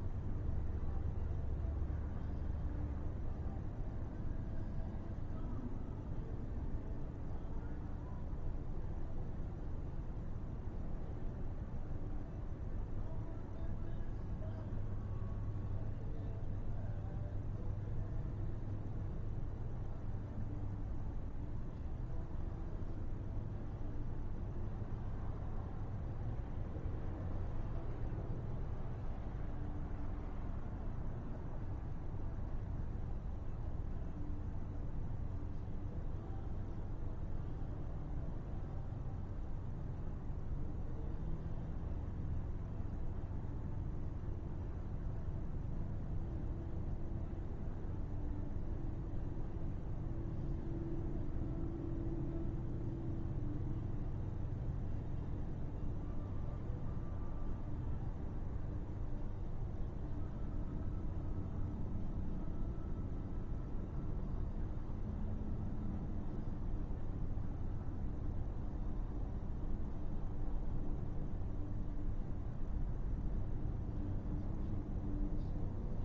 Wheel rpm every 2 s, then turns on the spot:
0, 0, 0, 0, 0, 0, 0, 0, 0, 0, 0, 0, 0, 0, 0, 0, 0, 0, 0, 0, 0, 0, 0, 0, 0, 0, 0, 0, 0, 0, 0, 0, 0, 0, 0, 0, 0, 0.
none